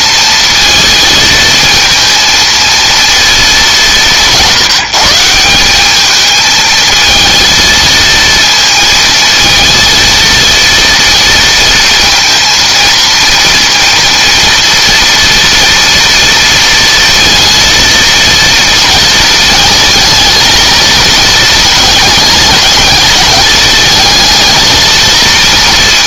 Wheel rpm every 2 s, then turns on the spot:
230, 230, 160, 220, 230, 230, 230, 230, 230, 220, 220, 220, 220.
none